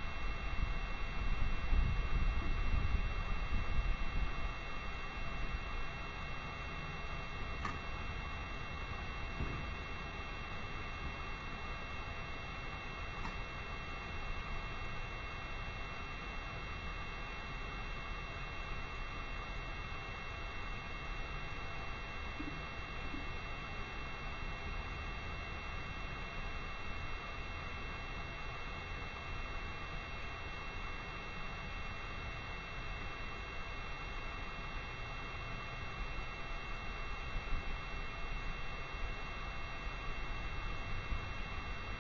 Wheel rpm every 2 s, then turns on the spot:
0, 0, 0, 0, 0, 0, 0, 0, 0, 0, 0, 0, 0, 0, 0, 0, 0, 0, 0, 0, 0.
none